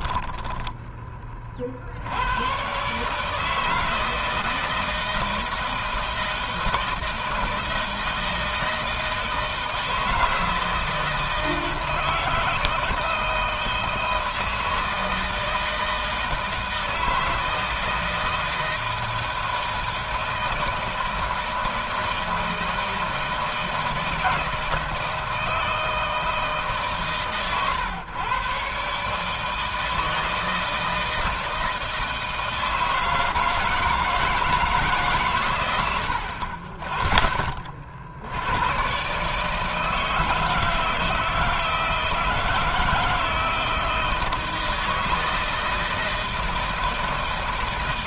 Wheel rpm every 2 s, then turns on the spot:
20, 140, 160, 160, 160, 160, 160, 160, 160, 160, 160, 160, 160, 140, 130, 160, 160, 140, 40, 120, 160, 160, 160, 160.
none